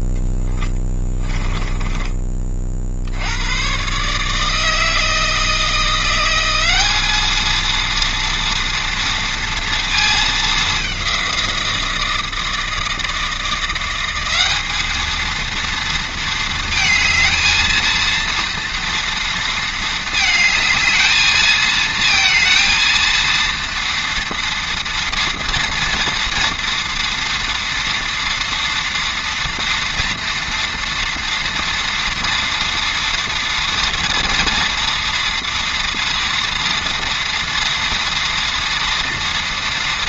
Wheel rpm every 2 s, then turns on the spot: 10, 20, 150, 180, 230, 220, 160, 190, 230, 230, 220, 230, 230, 240, 240, 240, 230, 230, 230, 230.
none